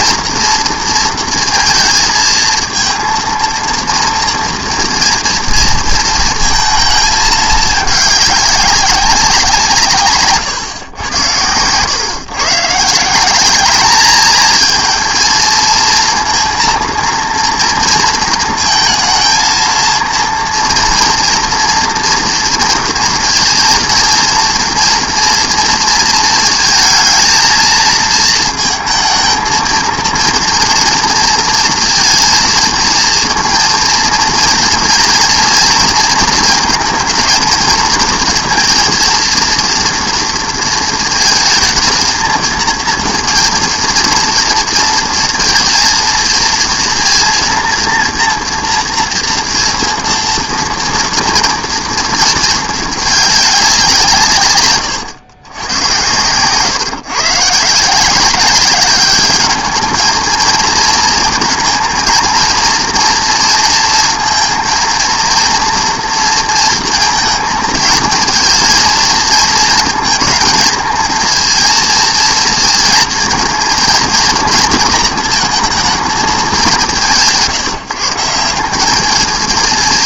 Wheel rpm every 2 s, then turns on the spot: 230, 230, 230, 220, 190, 110, 160, 230, 230, 230, 230, 230, 230, 230, 220, 230, 230, 230, 230, 230, 220, 230, 230, 230, 230, 230, 220, 120, 130, 200, 230, 230, 230, 230, 230, 230, 230, 220, 180, 190.
none